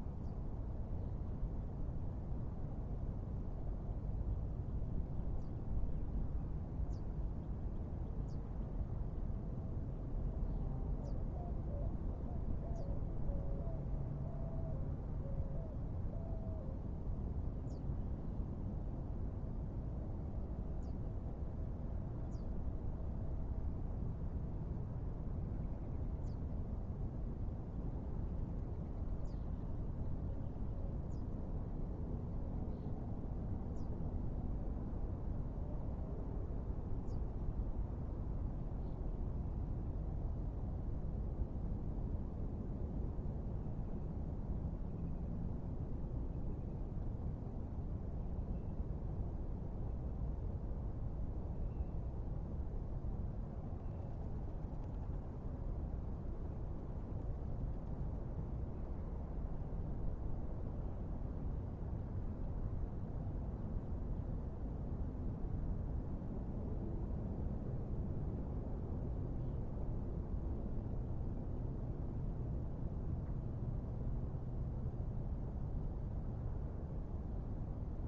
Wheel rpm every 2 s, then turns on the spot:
0, 0, 0, 0, 0, 0, 0, 0, 0, 0, 0, 0, 0, 0, 0, 0, 0, 0, 0, 0, 0, 0, 0, 0, 0, 0, 0, 0, 0, 0, 0, 0, 0, 0, 0, 0, 0, 0, 0.
none